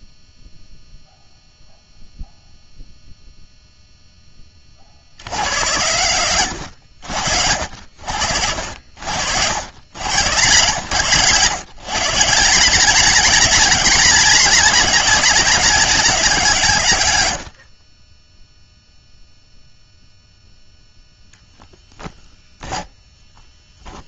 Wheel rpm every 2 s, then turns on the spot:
0, 30, 80, 60, 130, 160, 200, 160, 0, 0, 10, 10.
22-24